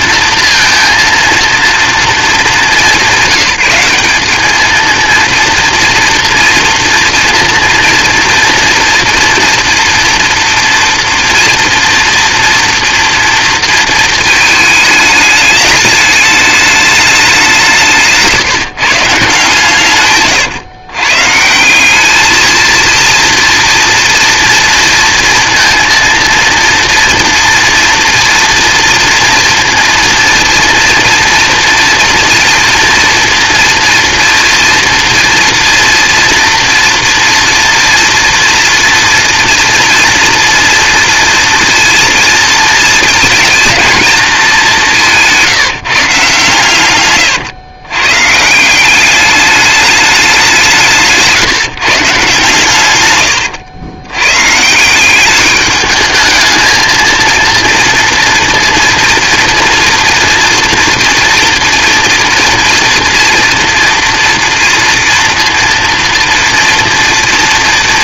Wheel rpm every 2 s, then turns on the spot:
230, 210, 220, 240, 230, 240, 230, 220, 210, 150, 120, 230, 230, 230, 230, 240, 230, 230, 230, 230, 230, 230, 200, 130, 170, 180, 120, 160, 220, 240, 230, 230, 230, 230.
none